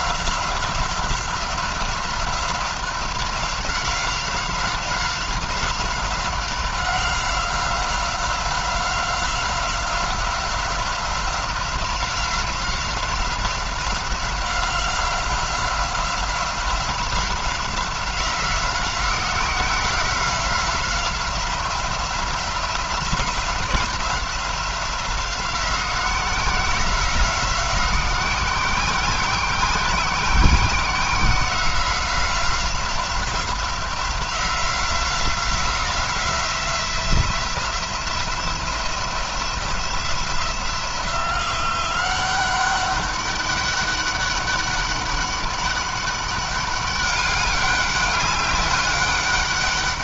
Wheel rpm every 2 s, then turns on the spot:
180, 180, 180, 190, 180, 180, 180, 180, 180, 180, 180, 180, 180, 180, 180, 180, 180, 180, 170, 170, 180, 190, 200, 200, 200.
none